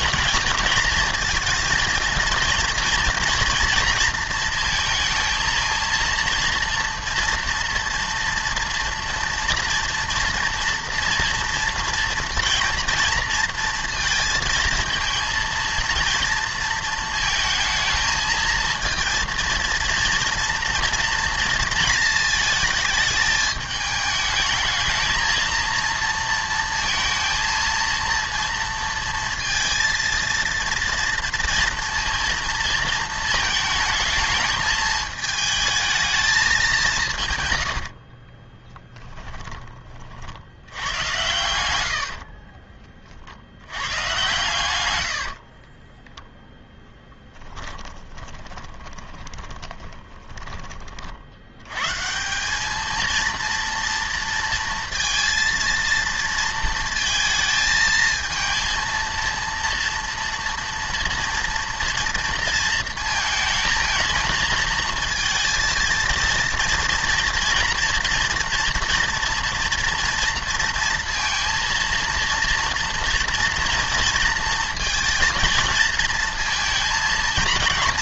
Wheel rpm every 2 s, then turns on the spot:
230, 230, 230, 230, 230, 230, 230, 230, 230, 230, 230, 220, 220, 230, 230, 230, 230, 220, 200, 20, 90, 30, 100, 0, 20, 20, 210, 230, 230, 230, 230, 230, 220, 230, 230, 230, 230, 230, 230.
38-40 42-44 48-50